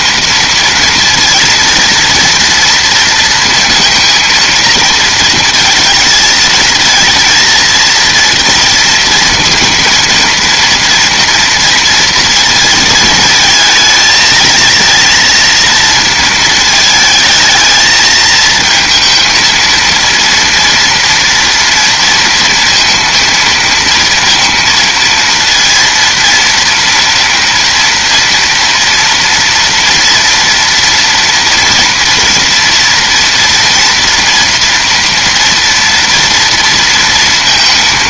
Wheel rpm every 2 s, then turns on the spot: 230, 230, 230, 220, 230, 230, 230, 220, 220, 230, 230, 230, 230, 230, 230, 230, 230, 230, 230.
none